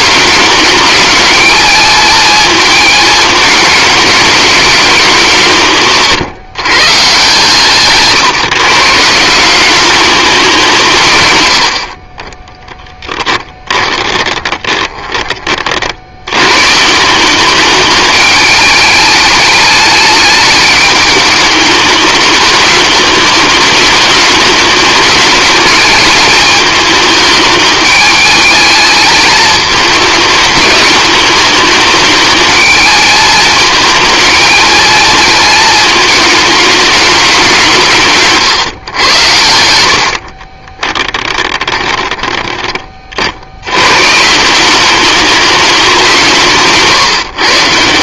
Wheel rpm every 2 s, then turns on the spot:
210, 220, 200, 130, 160, 160, 10, 20, 150, 210, 210, 210, 210, 220, 220, 210, 220, 220, 210, 110, 20, 40, 190, 160.
14-16 40-42